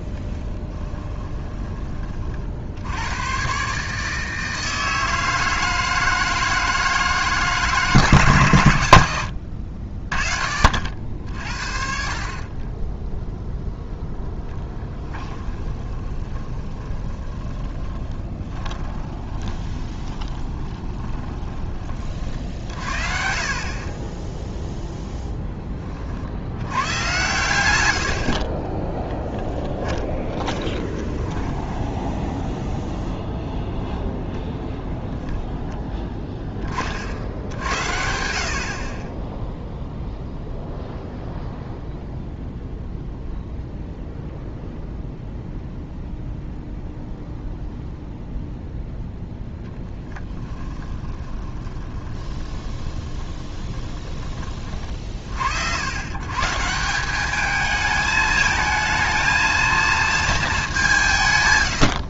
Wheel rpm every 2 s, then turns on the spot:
10, 80, 160, 160, 100, 60, 10, 10, 20, 20, 20, 50, 0, 110, 20, 20, 0, 0, 50, 20, 0, 0, 0, 0, 0, 20, 20, 40, 170, 220, 160.
0-2 14-22 28-32 50-54